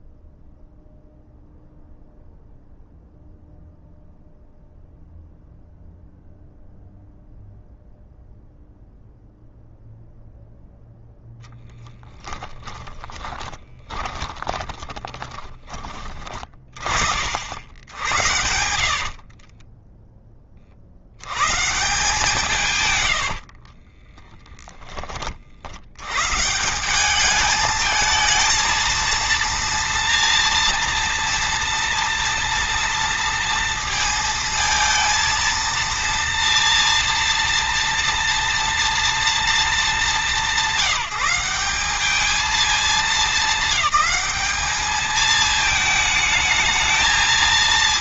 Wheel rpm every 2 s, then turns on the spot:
0, 0, 0, 0, 0, 0, 10, 20, 50, 60, 70, 110, 30, 180, 230, 230, 230, 230, 230, 230, 180, 220, 220, 220.
12-16 18-20 22-24